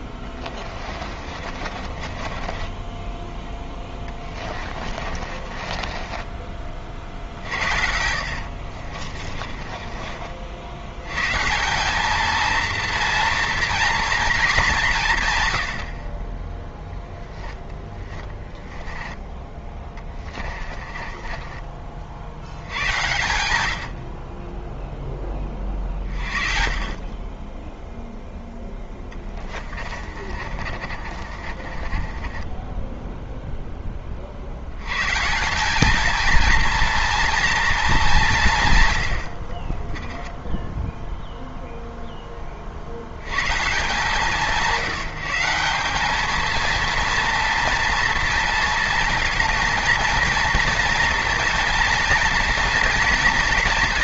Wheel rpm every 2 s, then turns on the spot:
40, 20, 30, 40, 50, 100, 230, 190, 10, 10, 30, 90, 0, 20, 10, 40, 10, 100, 230, 70, 10, 70, 160, 230, 230, 230, 230.
0-6 8-10 16-22 28-34